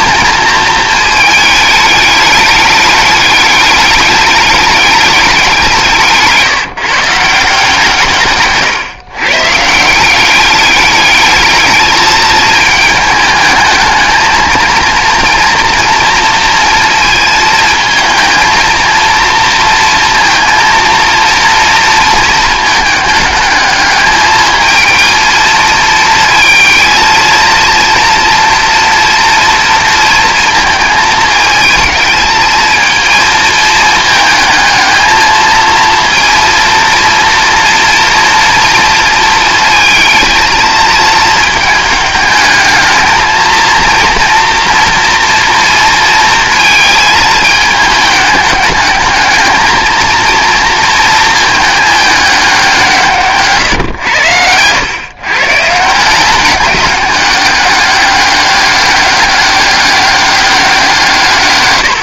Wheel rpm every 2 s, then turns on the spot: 220, 210, 210, 150, 140, 200, 220, 230, 230, 230, 230, 220, 220, 220, 230, 230, 230, 220, 230, 230, 220, 220, 230, 220, 210, 230, 170, 110, 200, 200, 180.
none